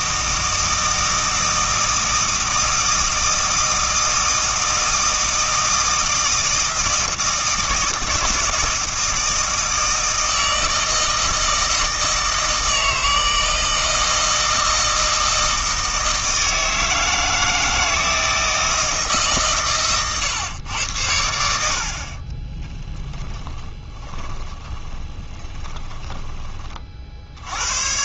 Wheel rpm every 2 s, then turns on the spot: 160, 160, 160, 160, 160, 160, 160, 160, 160, 160, 110, 10, 30, 30.
22-26